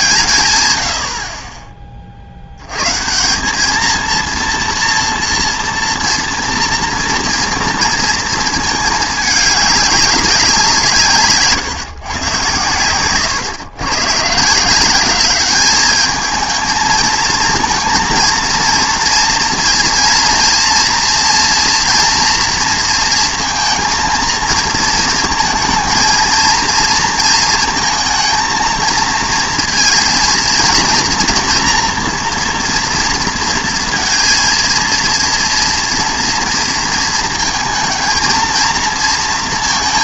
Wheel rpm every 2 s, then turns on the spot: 160, 90, 230, 240, 220, 170, 110, 160, 220, 230, 230, 230, 230, 230, 220, 230, 230, 230, 230, 230.
none